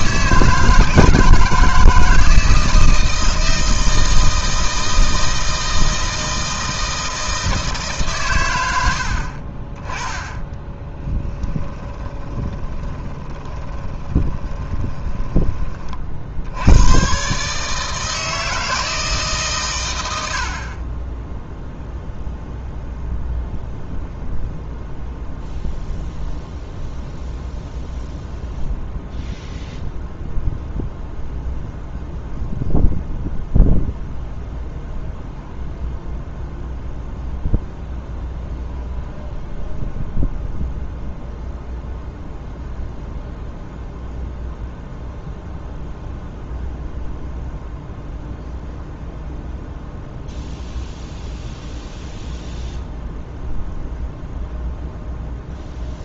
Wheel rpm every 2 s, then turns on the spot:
160, 160, 160, 160, 80, 20, 20, 20, 100, 160, 40, 0, 0, 0, 0, 0, 0, 0, 0, 0, 0, 0, 0, 0, 0, 0, 0, 0.
10-16